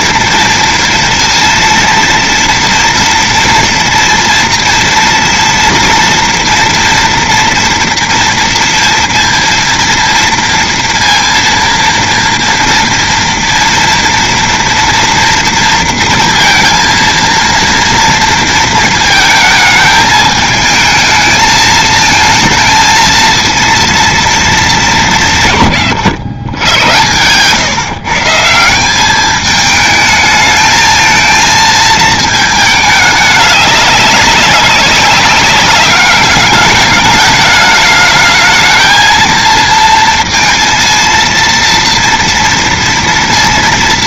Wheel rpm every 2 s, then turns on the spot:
230, 230, 230, 230, 230, 230, 230, 230, 230, 230, 220, 220, 210, 100, 180, 220, 210, 200, 210, 220, 230, 230.
none